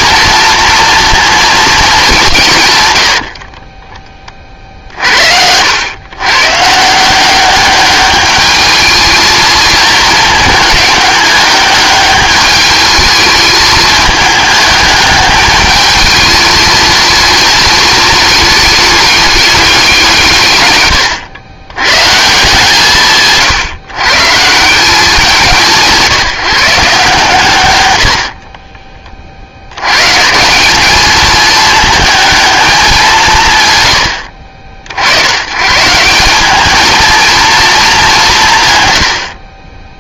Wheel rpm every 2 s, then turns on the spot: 230, 110, 50, 160, 210, 210, 210, 210, 220, 210, 120, 150, 180, 150, 30, 200, 210, 60, 220, 100.
2-4 20-22